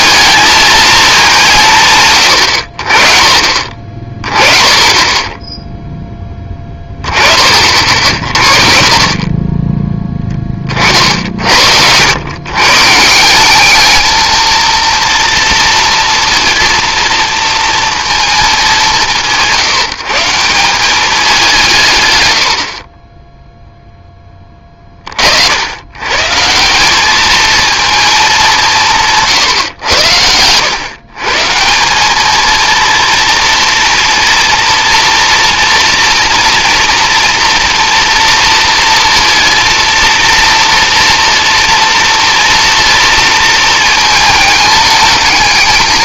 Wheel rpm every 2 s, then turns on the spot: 220, 60, 30, 20, 40, 40, 140, 230, 230, 200, 180, 60, 20, 170, 180, 120, 230, 230, 230, 230, 240, 230, 210.
8-10